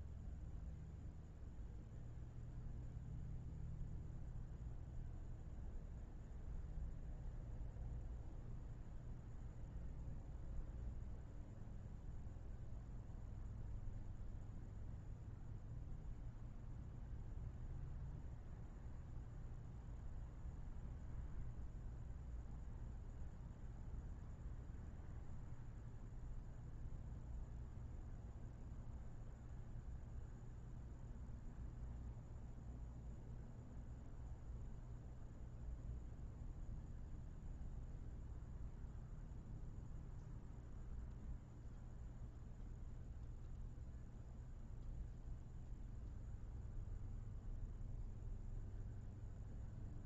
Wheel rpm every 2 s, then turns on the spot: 0, 0, 0, 0, 0, 0, 0, 0, 0, 0, 0, 0, 0, 0, 0, 0, 0, 0, 0, 0, 0, 0, 0, 0, 0.
none